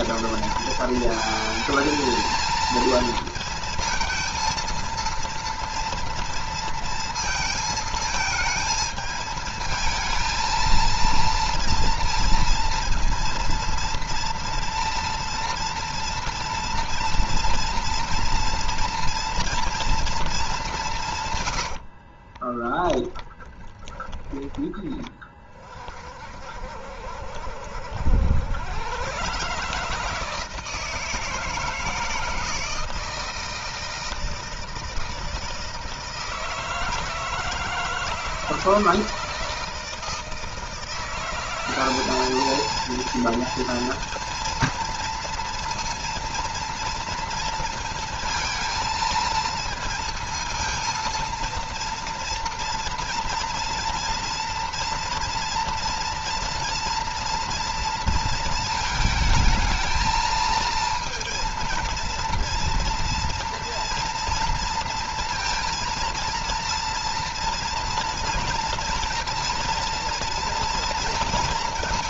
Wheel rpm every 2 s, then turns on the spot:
230, 230, 230, 230, 220, 230, 230, 230, 230, 230, 170, 20, 30, 60, 110, 160, 160, 160, 160, 160, 170, 230, 230, 230, 230, 230, 230, 230, 230, 220, 230, 230, 230, 230, 230, 230.
22-24